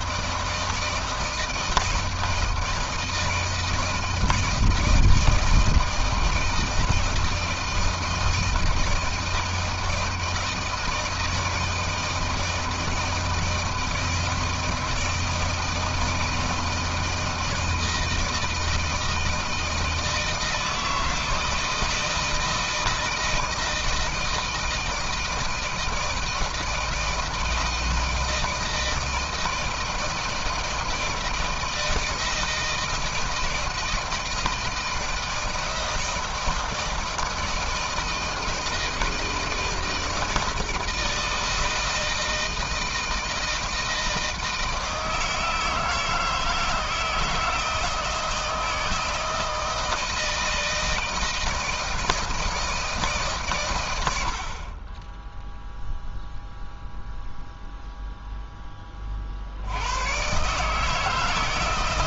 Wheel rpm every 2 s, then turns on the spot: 160, 160, 160, 160, 160, 160, 160, 160, 160, 160, 170, 160, 160, 160, 160, 160, 160, 160, 160, 160, 160, 160, 170, 160, 160, 160, 160, 70, 0, 0, 120.
none